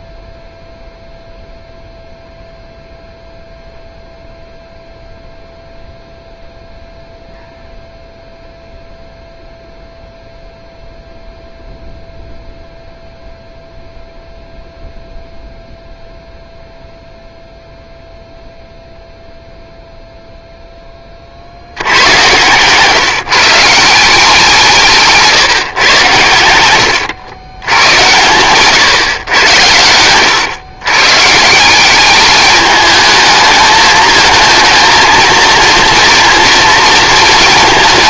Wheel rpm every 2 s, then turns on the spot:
0, 0, 0, 0, 0, 0, 0, 0, 0, 0, 0, 130, 180, 90, 120, 120, 210, 230, 230.
none